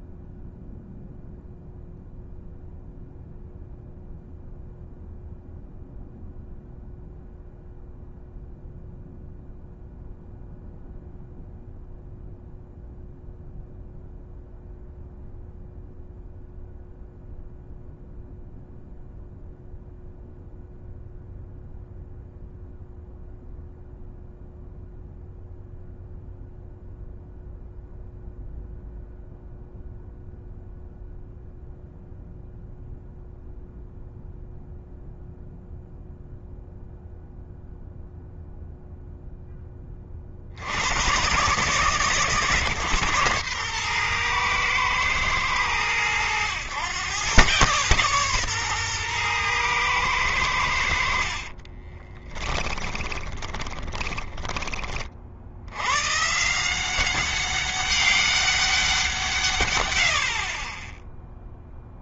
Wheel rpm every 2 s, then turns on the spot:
0, 0, 0, 0, 0, 0, 0, 0, 0, 0, 0, 0, 0, 0, 0, 0, 0, 0, 0, 0, 50, 130, 120, 100, 120, 90, 10, 20, 150, 190, 40.
52-54